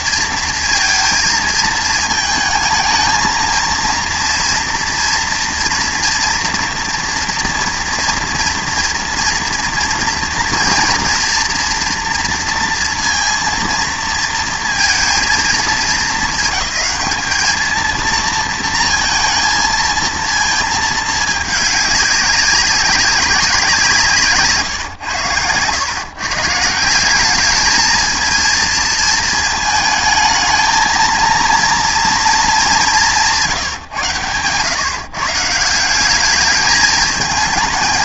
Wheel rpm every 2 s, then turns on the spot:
230, 220, 230, 240, 230, 230, 230, 220, 210, 230, 230, 200, 140, 150, 230, 220, 210, 120, 210.
none